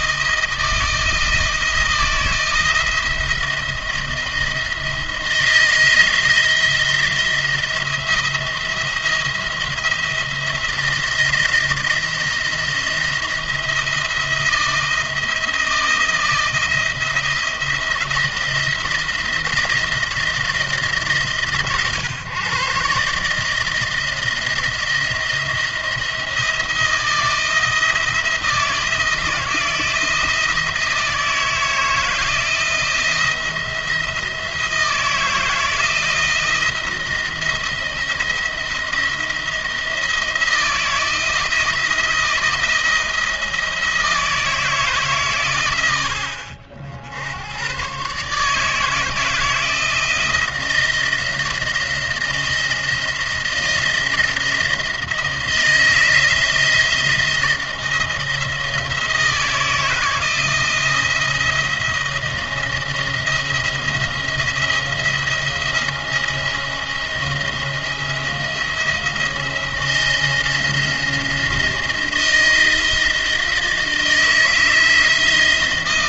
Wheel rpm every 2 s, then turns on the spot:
160, 160, 160, 170, 170, 170, 170, 170, 170, 170, 150, 140, 170, 160, 160, 160, 170, 160, 160, 170, 170, 170, 150, 60, 160, 170, 170, 160, 160, 170, 170, 170, 170, 170, 170, 170, 170, 160.
none